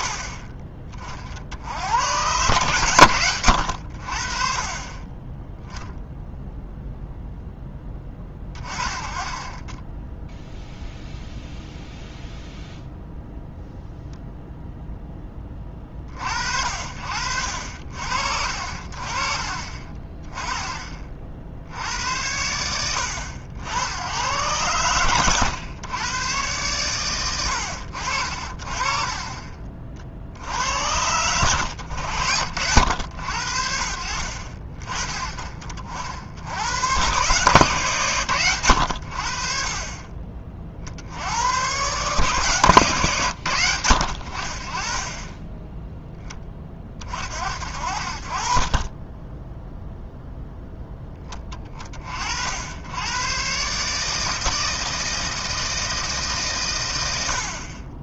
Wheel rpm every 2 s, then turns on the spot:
40, 130, 30, 0, 20, 0, 0, 0, 60, 50, 30, 80, 120, 120, 30, 80, 80, 40, 100, 80, 60, 120, 30, 20, 30, 10, 90, 160, 110.
none